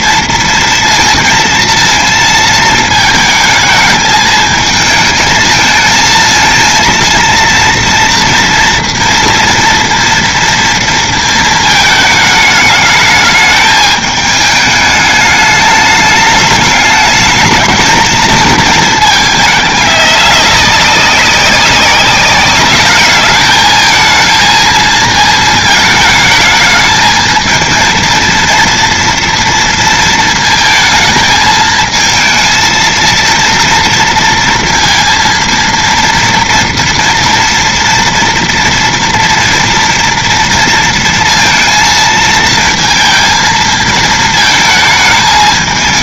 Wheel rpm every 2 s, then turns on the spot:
230, 220, 220, 230, 230, 230, 210, 210, 210, 220, 200, 200, 230, 220, 230, 220, 220, 230, 230, 230, 230, 230, 220.
none